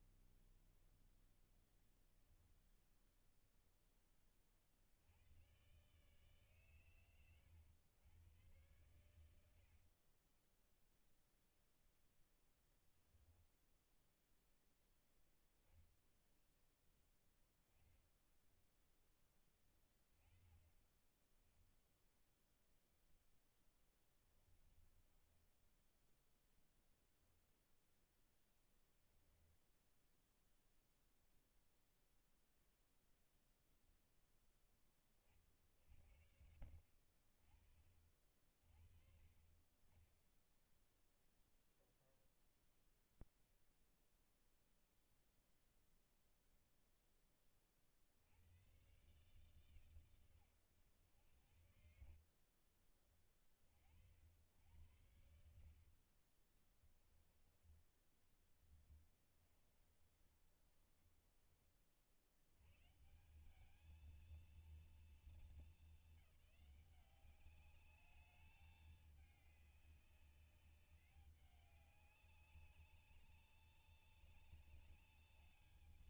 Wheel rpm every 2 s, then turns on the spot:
0, 0, 30, 130, 100, 20, 0, 0, 0, 10, 10, 0, 20, 10, 0, 0, 0, 10, 50, 40, 20, 0, 0, 0, 80, 110, 50, 80, 40, 20, 30, 80, 230, 200, 210, 200, 200, 200.
18-20 24-26 52-54 56-62